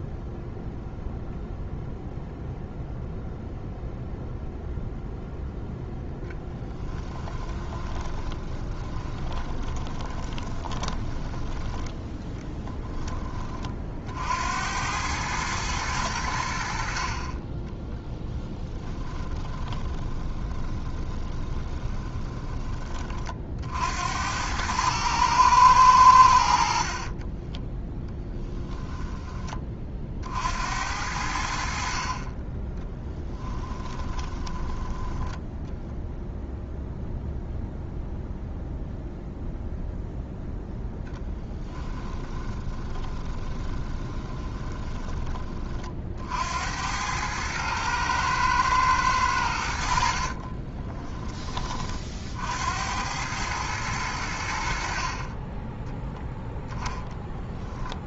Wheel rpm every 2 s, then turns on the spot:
0, 0, 0, 10, 20, 20, 10, 100, 60, 20, 20, 30, 110, 40, 20, 80, 10, 10, 0, 0, 0, 20, 20, 90, 110, 30, 90, 50, 0.
6-12 16-22 26-30 32-36 42-46 50-52